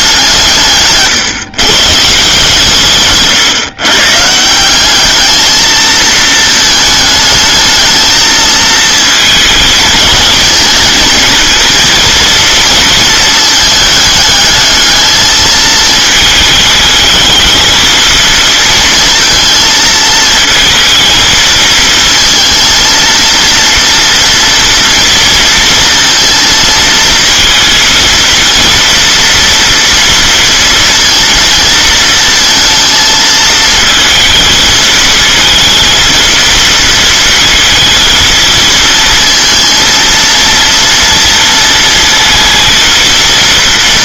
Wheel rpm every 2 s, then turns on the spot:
150, 150, 200, 220, 220, 220, 230, 220, 220, 230, 230, 230, 230, 230, 230, 230, 220, 220, 230, 220, 230, 230.
0-2